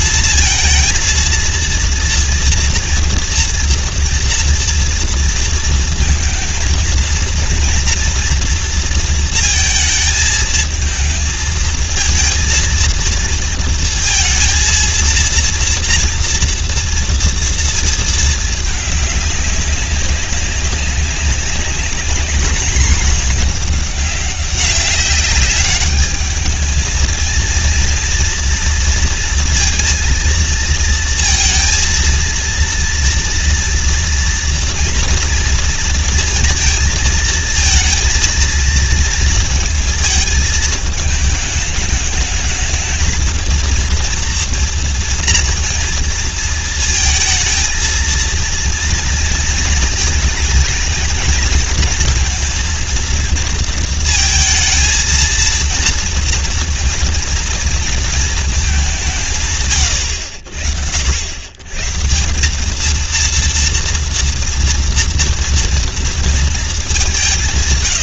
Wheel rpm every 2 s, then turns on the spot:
220, 230, 230, 230, 240, 220, 230, 230, 230, 210, 200, 210, 190, 220, 230, 230, 230, 230, 220, 230, 220, 220, 230, 230, 230, 220, 230, 230, 230, 210, 80, 210, 230, 220.
none